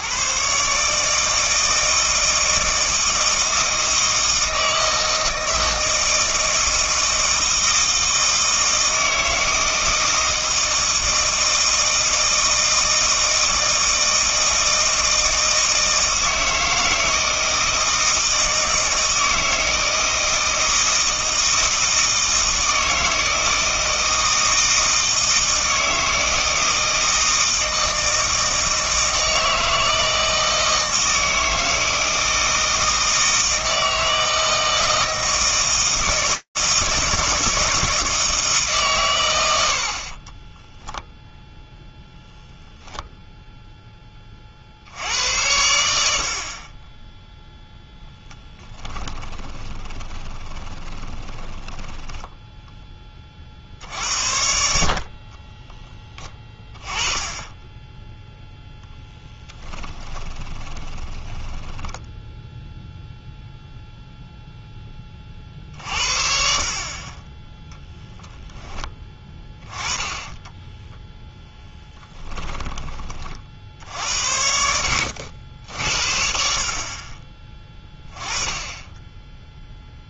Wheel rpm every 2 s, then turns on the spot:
150, 160, 160, 160, 160, 160, 160, 160, 160, 160, 160, 160, 160, 160, 160, 160, 160, 160, 160, 130, 0, 0, 70, 20, 10, 20, 10, 60, 20, 0, 20, 0, 0, 50, 10, 10, 10, 70, 40, 10.
48-52 60-62 70-72